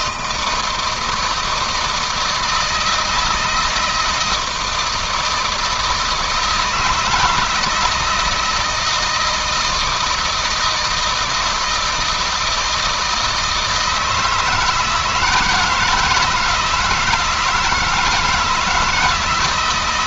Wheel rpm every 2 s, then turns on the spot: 160, 160, 160, 160, 160, 160, 160, 160, 170, 160.
none